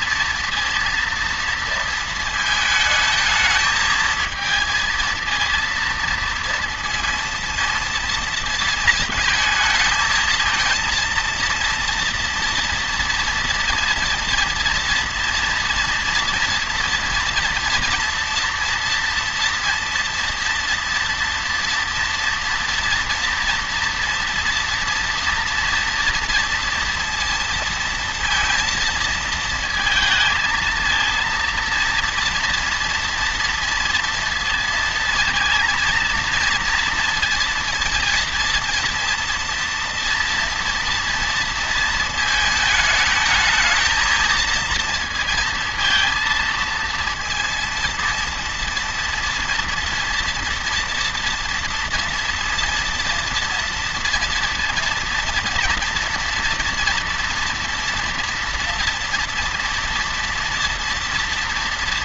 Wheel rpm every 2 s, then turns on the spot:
230, 220, 230, 230, 220, 230, 230, 230, 230, 230, 230, 240, 240, 230, 220, 230, 230, 230, 230, 230, 230, 220, 230, 230, 230, 240, 230, 230, 230, 230, 230.
none